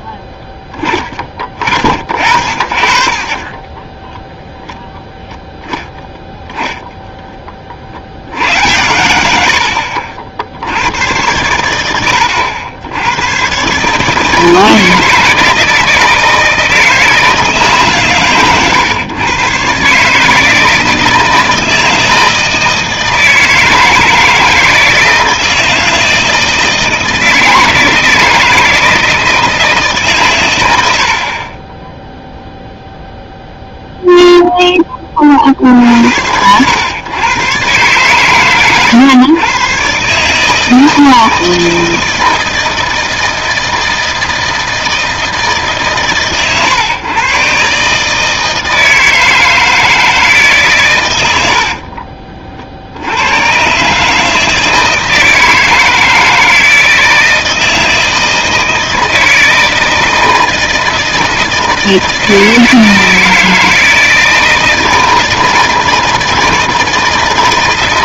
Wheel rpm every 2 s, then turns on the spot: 10, 60, 0, 0, 90, 80, 80, 160, 160, 130, 160, 160, 160, 160, 160, 100, 0, 10, 100, 120, 160, 160, 160, 120, 160, 140, 60, 160, 160, 160, 160, 160, 160, 160.
none